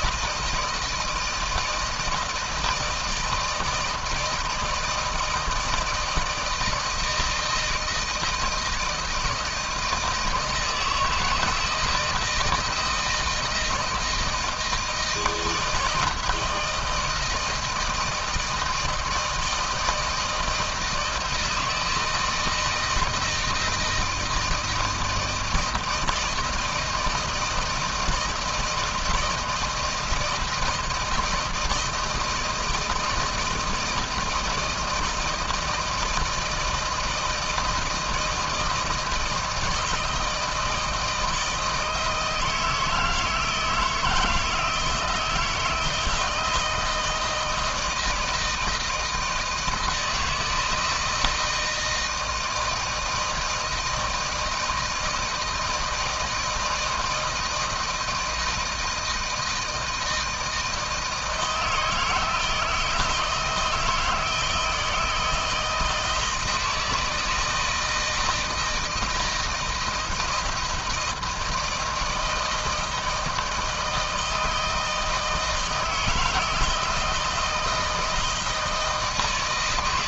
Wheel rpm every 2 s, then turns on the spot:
160, 160, 160, 160, 160, 160, 160, 160, 160, 160, 160, 160, 170, 160, 160, 170, 160, 160, 160, 160, 160, 160, 160, 160, 160, 160, 160, 160, 160, 160, 160, 160, 160, 160, 170, 170, 160, 160, 160, 160.
none